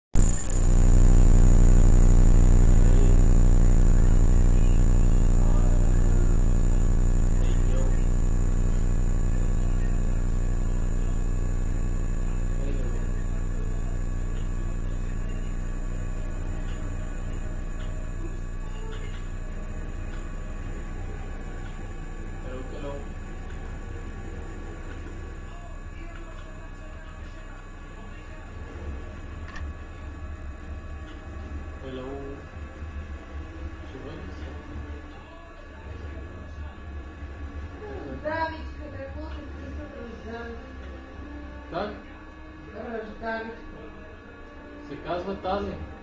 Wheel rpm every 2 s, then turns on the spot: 0, 0, 0, 0, 0, 0, 0, 0, 0, 0, 0, 0, 0, 0, 0, 0, 0, 0, 0, 0, 0, 0, 0.
none